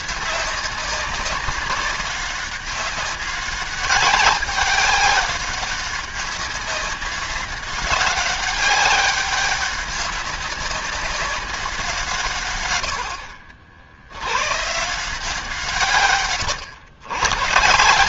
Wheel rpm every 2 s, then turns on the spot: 190, 200, 200, 200, 200, 190, 100, 140, 120.
none